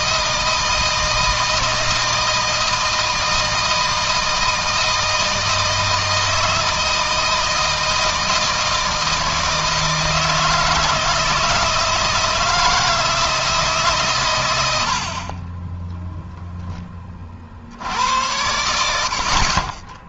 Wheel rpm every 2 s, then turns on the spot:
160, 160, 160, 160, 160, 160, 160, 70, 30, 80.
none